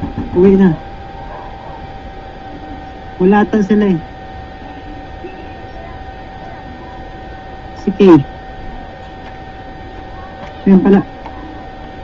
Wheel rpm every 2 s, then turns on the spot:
0, 0, 0, 0, 0, 0.
none